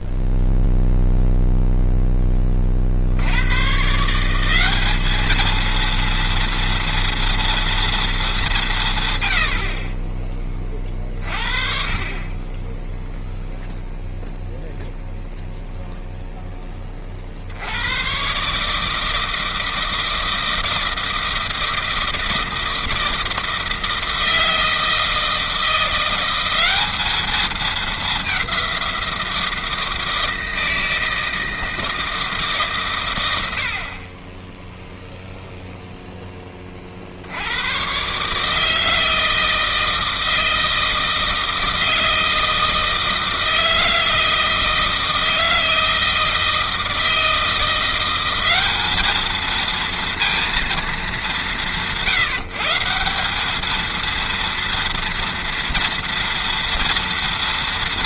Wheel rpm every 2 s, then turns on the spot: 0, 50, 200, 230, 150, 30, 10, 0, 20, 160, 160, 160, 160, 200, 180, 160, 130, 0, 50, 160, 160, 160, 160, 160, 210, 200, 170, 230, 230.
none